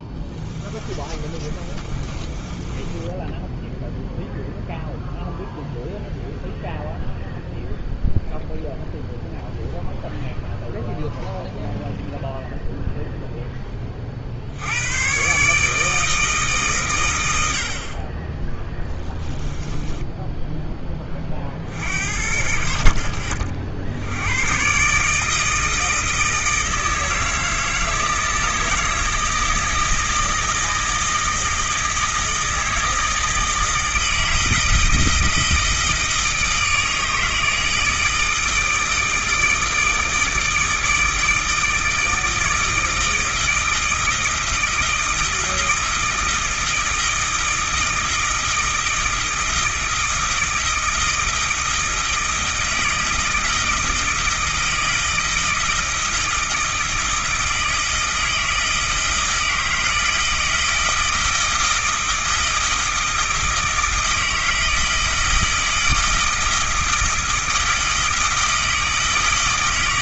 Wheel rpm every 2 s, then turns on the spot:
20, 20, 0, 0, 0, 0, 0, 90, 130, 20, 10, 60, 130, 160, 160, 160, 160, 160, 160, 160, 160, 160, 160, 160, 160, 160, 160, 160, 160, 160, 160, 160, 160, 160, 160.
0-4 18-20